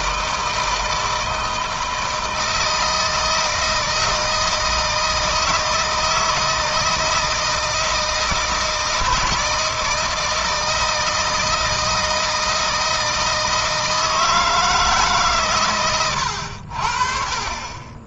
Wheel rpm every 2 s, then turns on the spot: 160, 160, 160, 160, 160, 160, 160, 160, 70.
none